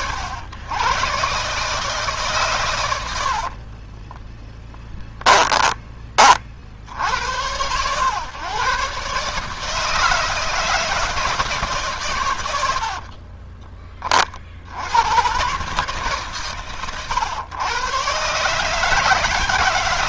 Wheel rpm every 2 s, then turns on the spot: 70, 140, 20, 10, 100, 160, 140, 40, 140, 130.
4-6